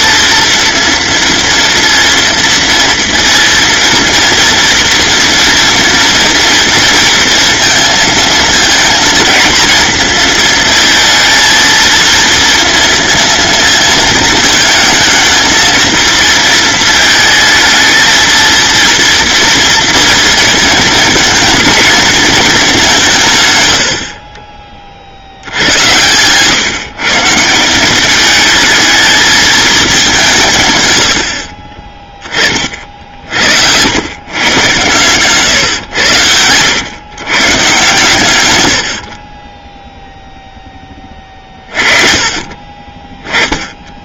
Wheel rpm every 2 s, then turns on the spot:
230, 230, 230, 230, 230, 230, 230, 230, 220, 230, 230, 180, 50, 150, 220, 110, 50, 130, 110, 80, 10, 30.
none